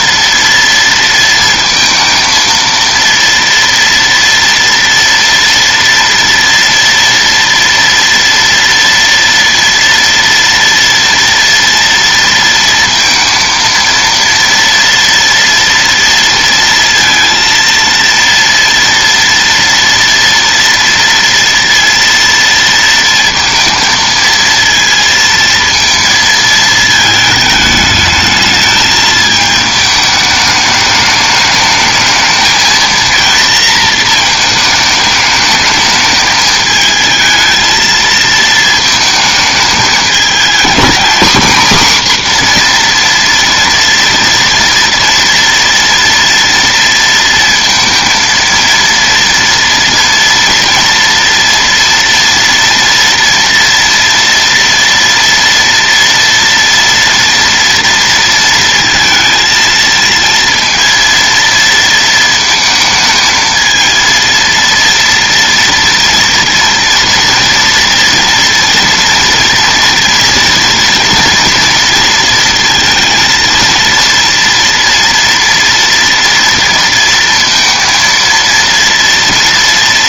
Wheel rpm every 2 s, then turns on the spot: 230, 230, 230, 230, 230, 230, 230, 230, 230, 230, 230, 230, 230, 220, 220, 210, 230, 210, 220, 220, 240, 240, 230, 230, 230, 230, 230, 230, 230, 230, 230, 220, 230, 230, 230, 230, 230, 230, 230, 230.
none